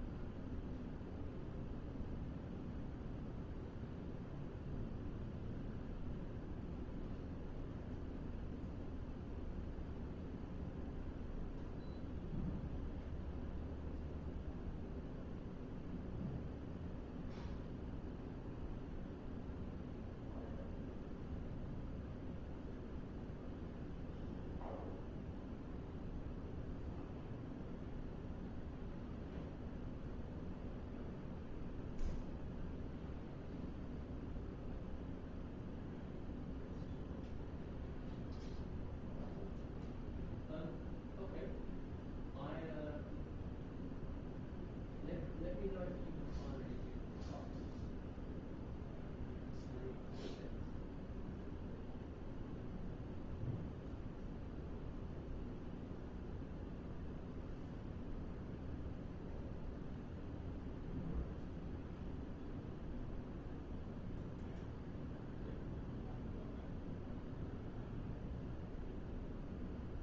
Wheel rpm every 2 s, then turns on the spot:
0, 0, 0, 0, 0, 0, 0, 0, 0, 0, 0, 0, 0, 0, 0, 0, 0, 0, 0, 0, 0, 0, 0, 0, 0, 0, 0, 0, 0, 0, 0, 0, 0, 0, 0.
none